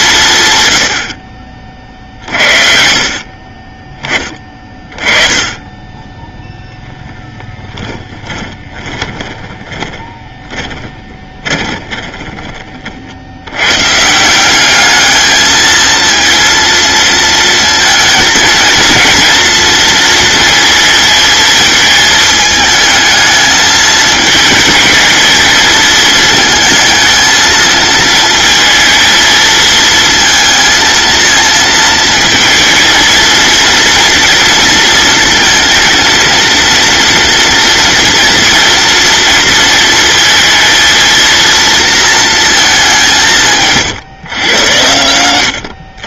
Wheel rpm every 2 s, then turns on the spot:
100, 50, 30, 0, 20, 20, 40, 200, 230, 230, 220, 220, 220, 220, 220, 230, 230, 230, 230, 230, 230, 210, 100.
8-12